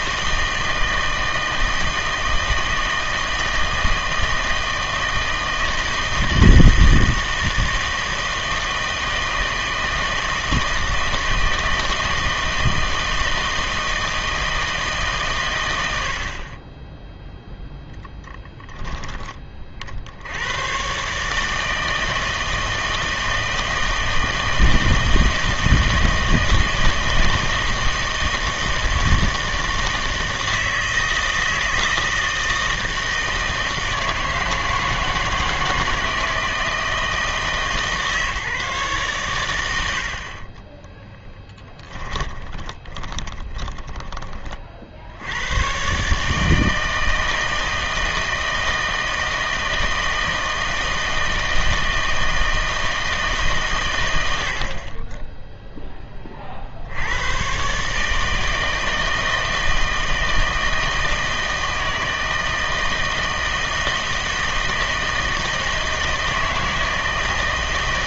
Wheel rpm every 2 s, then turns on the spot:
160, 160, 160, 160, 160, 160, 160, 160, 20, 10, 110, 160, 160, 160, 160, 160, 160, 160, 160, 140, 30, 20, 50, 160, 160, 160, 160, 60, 50, 160, 160, 160, 160, 160.
16-18 40-44